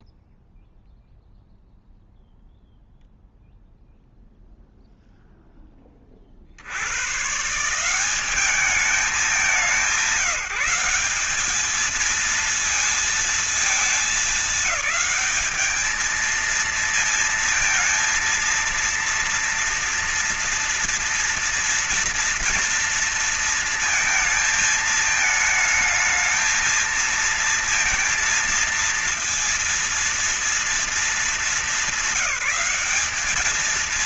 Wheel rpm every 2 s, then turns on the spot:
0, 0, 0, 80, 200, 180, 230, 210, 230, 230, 230, 230, 220, 230, 230, 230, 190.
none